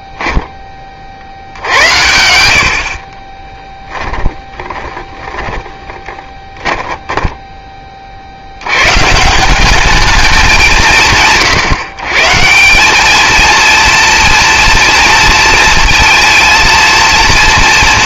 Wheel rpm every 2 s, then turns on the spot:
20, 70, 20, 10, 80, 180, 160, 230, 230.
4-8